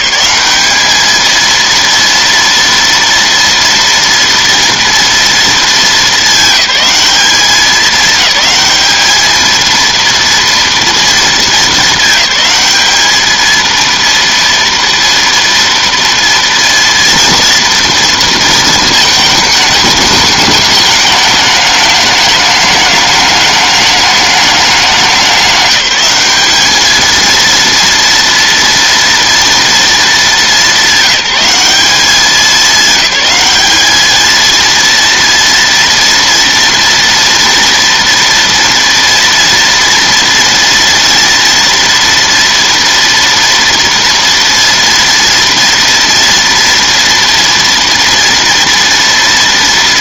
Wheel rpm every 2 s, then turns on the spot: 210, 230, 230, 210, 210, 230, 200, 230, 230, 220, 210, 210, 210, 220, 230, 200, 200, 230, 230, 230, 230, 230, 230, 230, 230.
none